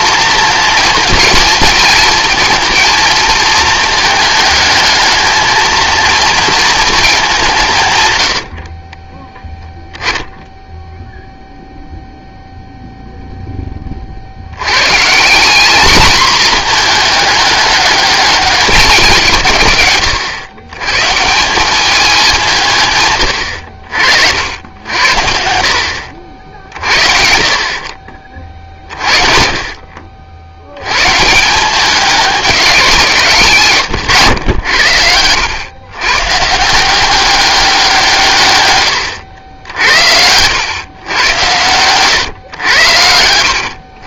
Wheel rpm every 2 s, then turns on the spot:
230, 230, 220, 220, 40, 0, 0, 110, 220, 210, 120, 160, 90, 50, 50, 100, 190, 90, 170, 120, 110, 100.
34-36